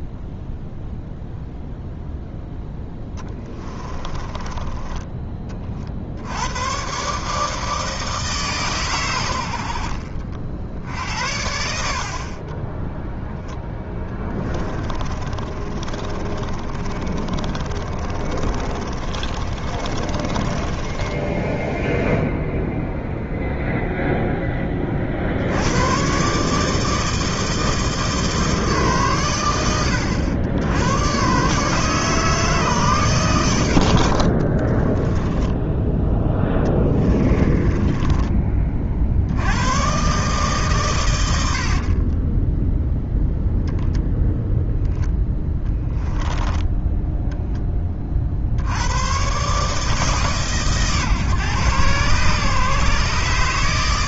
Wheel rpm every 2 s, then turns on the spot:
0, 10, 20, 110, 130, 60, 20, 20, 40, 30, 10, 0, 30, 160, 120, 100, 140, 20, 10, 30, 140, 0, 0, 10, 80, 140, 140.
4-6 14-22 34-38 46-48